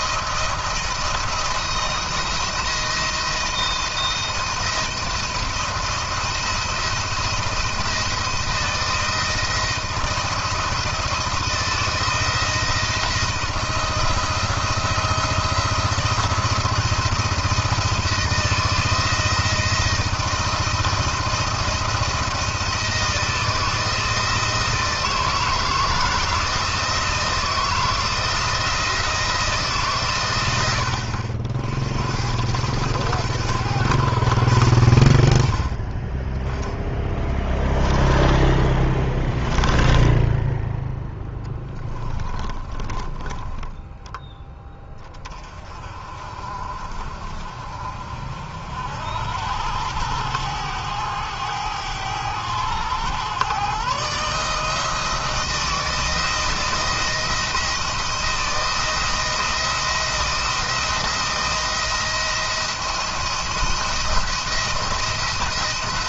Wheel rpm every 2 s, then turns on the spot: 170, 170, 170, 170, 170, 170, 170, 160, 170, 170, 170, 170, 160, 160, 170, 80, 90, 90, 10, 10, 10, 30, 10, 40, 70, 100, 100, 160, 170, 170, 170, 170, 170.
38-40 42-44